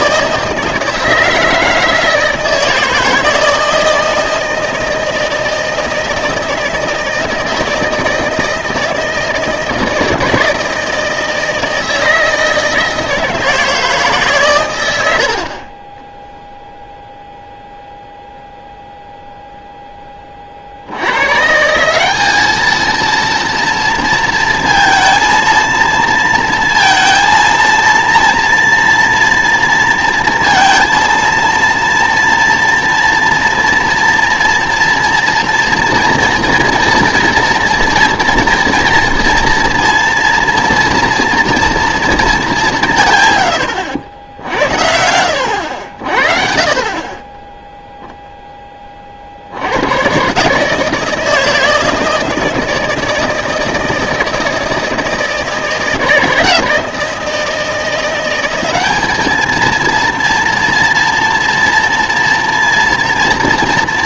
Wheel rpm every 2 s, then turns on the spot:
160, 160, 160, 160, 160, 160, 160, 120, 0, 0, 50, 210, 220, 230, 230, 230, 230, 230, 230, 230, 230, 190, 70, 40, 10, 140, 160, 160, 160, 200, 230, 230.
none